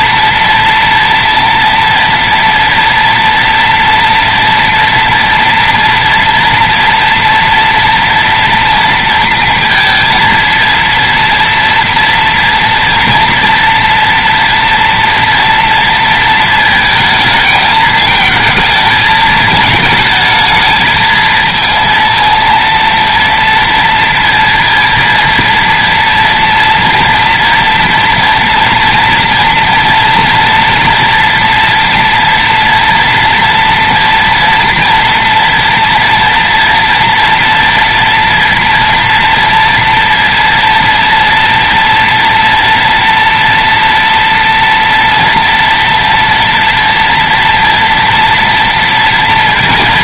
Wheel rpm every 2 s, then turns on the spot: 230, 230, 230, 230, 230, 230, 230, 230, 220, 220, 220, 230, 230, 230, 230, 230, 230, 230, 240, 230, 230, 230, 240, 230, 230.
none